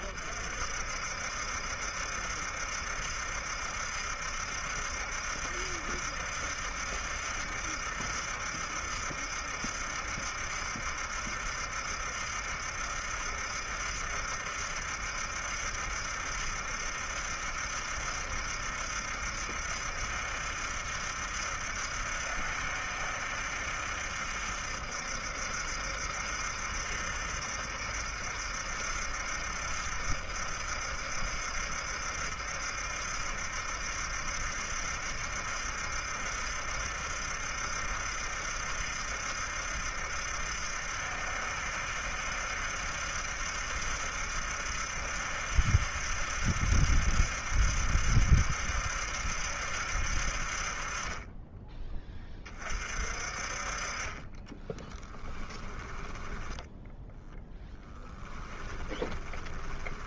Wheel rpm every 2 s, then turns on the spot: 60, 70, 70, 70, 70, 70, 70, 70, 70, 70, 70, 70, 70, 70, 70, 70, 70, 70, 70, 70, 70, 70, 70, 70, 70, 30, 40, 10, 0, 20.
54-56 58-60